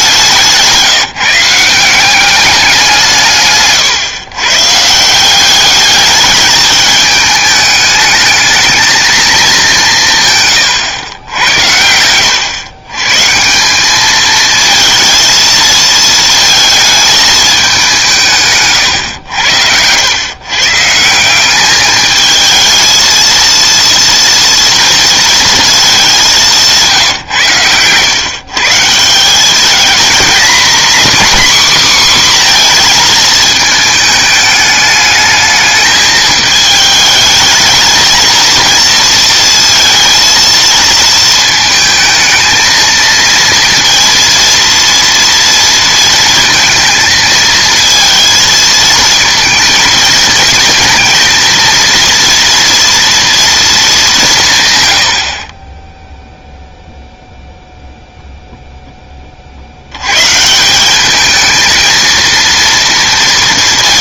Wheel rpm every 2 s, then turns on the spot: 160, 190, 140, 210, 210, 130, 120, 220, 220, 130, 140, 220, 230, 170, 150, 240, 240, 210, 220, 230, 230, 220, 230, 230, 220, 230, 230, 140, 0, 0, 180, 230.
26-28